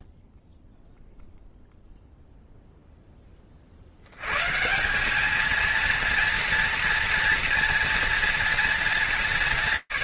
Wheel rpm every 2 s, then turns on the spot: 0, 0, 140, 230, 230.
none